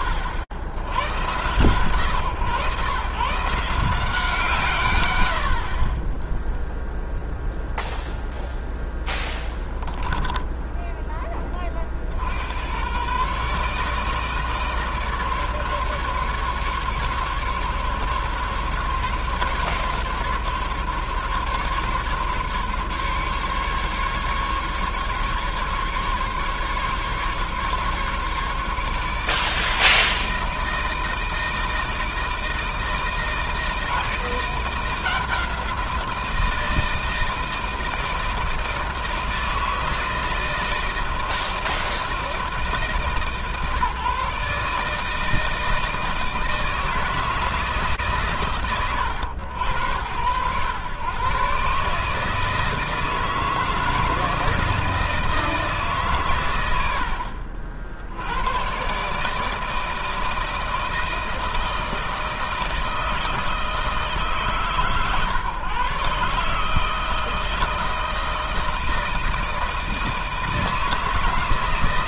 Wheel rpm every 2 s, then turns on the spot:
100, 130, 130, 0, 10, 10, 110, 150, 140, 140, 140, 140, 140, 140, 150, 160, 160, 170, 160, 160, 160, 150, 150, 160, 110, 110, 160, 160, 70, 130, 160, 160, 140, 160, 160, 160.
10-12